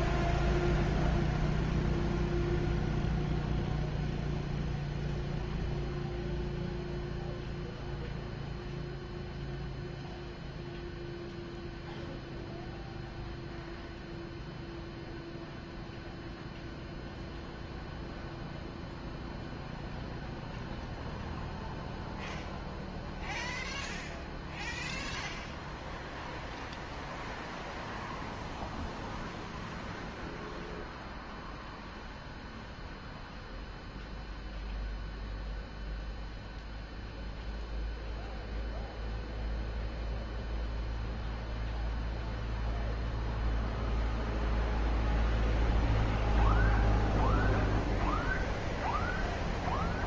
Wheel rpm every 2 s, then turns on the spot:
0, 0, 0, 0, 0, 0, 0, 0, 0, 0, 0, 0, 0, 0, 0, 0, 0, 0, 0, 0, 0, 0, 0, 0, 0.
none